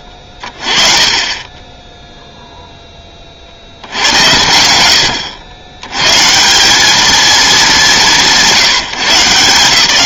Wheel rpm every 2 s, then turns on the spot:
30, 10, 90, 180, 160.
none